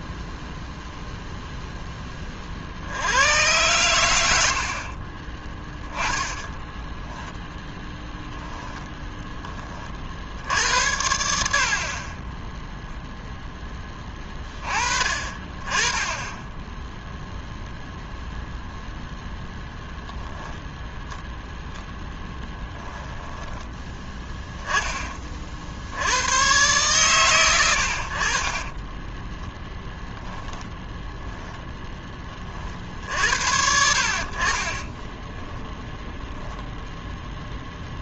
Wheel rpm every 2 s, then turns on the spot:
0, 80, 50, 10, 0, 70, 0, 30, 10, 0, 0, 10, 20, 120, 20, 0, 50, 30, 0.
4-8 22-24 28-30 34-36